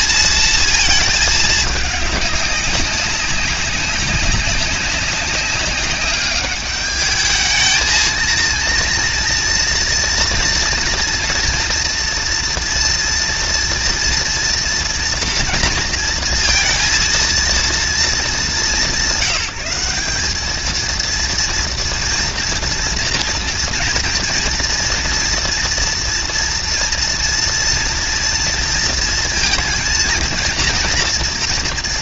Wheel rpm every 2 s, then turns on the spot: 220, 200, 200, 210, 230, 230, 240, 230, 230, 190, 220, 230, 230, 230, 230, 230.
none